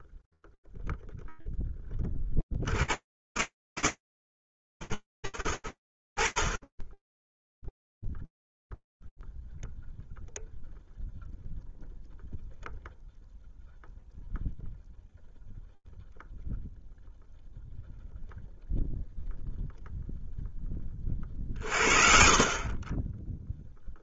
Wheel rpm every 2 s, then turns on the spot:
0, 20, 110, 50, 0, 0, 0, 0, 0, 0, 10, 30.
none